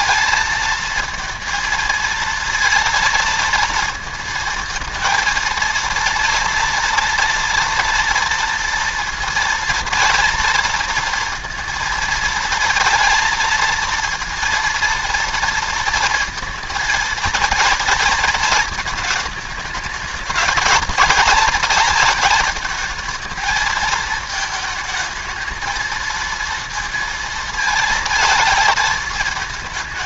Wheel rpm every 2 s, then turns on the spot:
220, 230, 230, 230, 230, 230, 230, 230, 230, 220, 220, 220, 220, 230, 230.
none